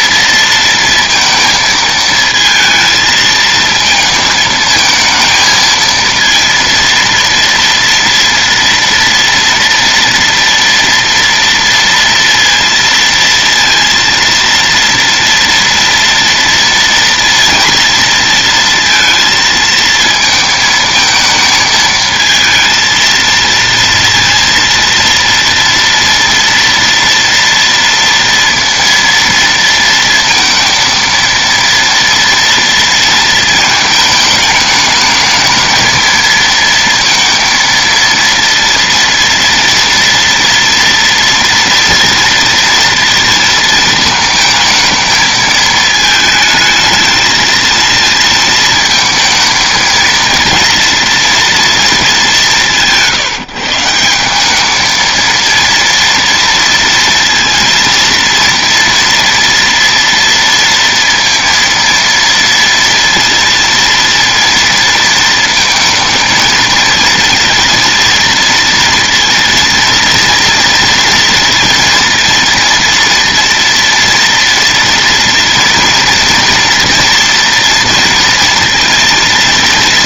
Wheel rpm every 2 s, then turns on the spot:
230, 220, 220, 230, 230, 230, 230, 230, 230, 230, 220, 230, 230, 230, 230, 230, 230, 220, 230, 230, 230, 230, 220, 220, 230, 230, 210, 200, 230, 230, 230, 230, 230, 230, 230, 230, 230, 230, 230, 230.
none